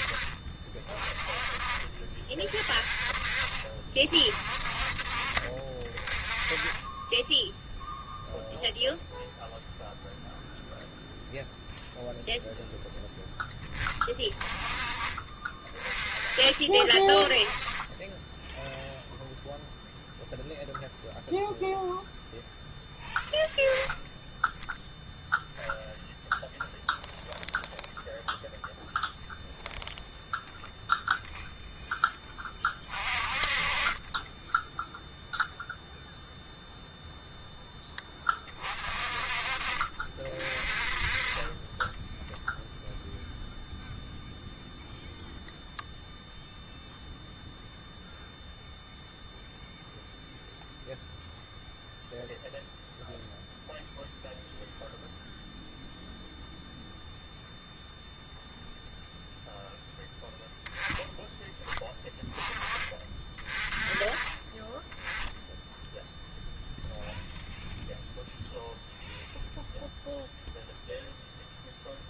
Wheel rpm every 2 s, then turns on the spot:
30, 30, 40, 20, 0, 0, 0, 30, 30, 0, 0, 0, 0, 0, 0, 0, 30, 0, 0, 30, 30, 0, 0, 0, 0, 0, 0, 0, 0, 0, 0, 20, 20, 0, 0, 0.
none